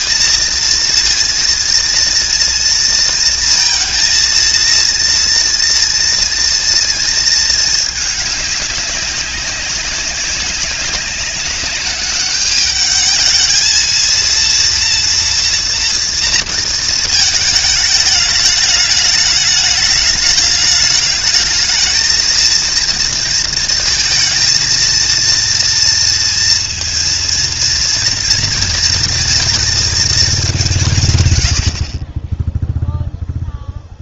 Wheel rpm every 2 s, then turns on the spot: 230, 230, 230, 230, 200, 200, 210, 230, 230, 210, 210, 220, 230, 230, 230, 190, 10.
none